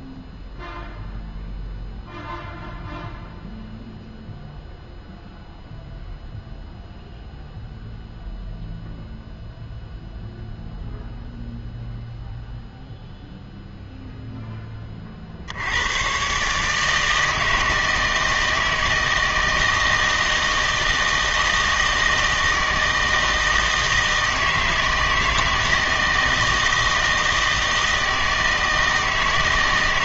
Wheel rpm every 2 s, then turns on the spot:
0, 0, 0, 0, 0, 0, 0, 10, 150, 160, 160, 160, 160, 160, 160.
none